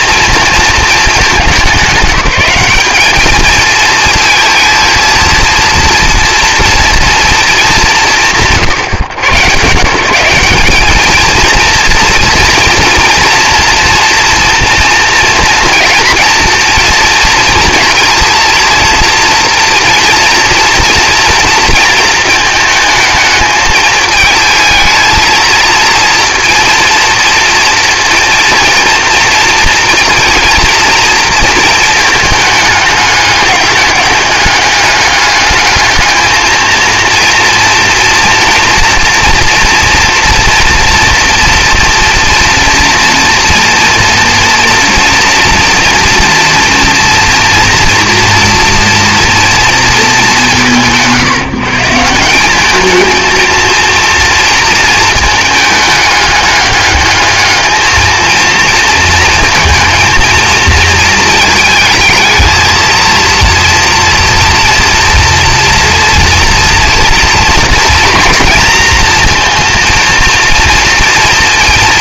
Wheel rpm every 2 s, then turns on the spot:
230, 210, 230, 230, 160, 200, 230, 230, 230, 230, 230, 220, 220, 230, 230, 230, 210, 210, 230, 240, 230, 240, 230, 230, 230, 170, 200, 230, 210, 230, 230, 220, 240, 240, 230, 230.
none